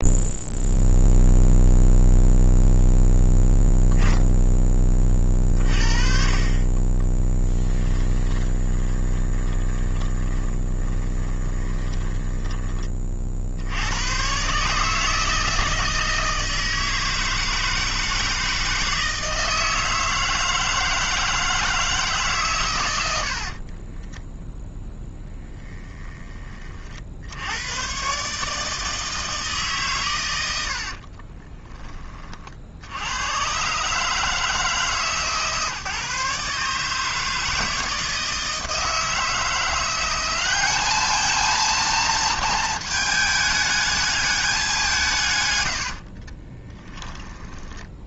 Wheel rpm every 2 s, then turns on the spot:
0, 0, 30, 20, 20, 20, 30, 160, 160, 160, 160, 80, 20, 60, 160, 40, 80, 150, 150, 160, 220, 220, 160, 10.
6-12 24-26 30-32